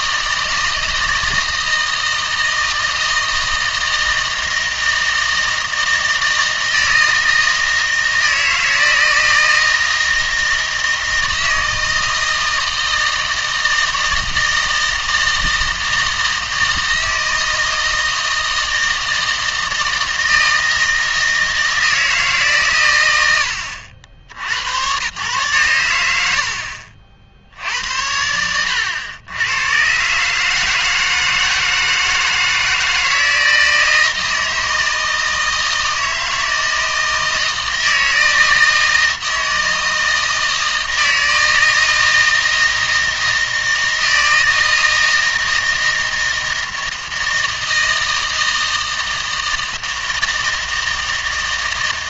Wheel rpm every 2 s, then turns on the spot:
160, 160, 160, 160, 160, 160, 160, 160, 160, 160, 160, 130, 90, 70, 90, 160, 160, 160, 160, 160, 160, 160, 160, 160, 160, 160.
none